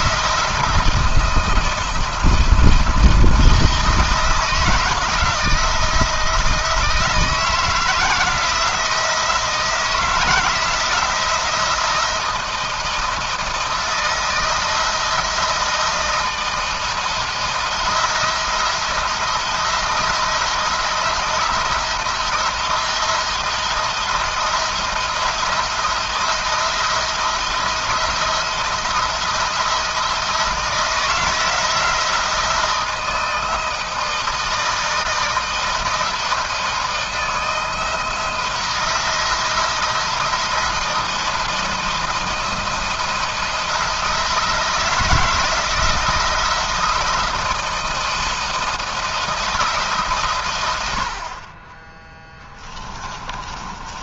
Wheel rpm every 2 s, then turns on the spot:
160, 170, 160, 160, 170, 160, 170, 160, 170, 170, 170, 170, 170, 170, 170, 160, 160, 160, 170, 170, 170, 160, 160, 170, 170, 100, 20.
52-54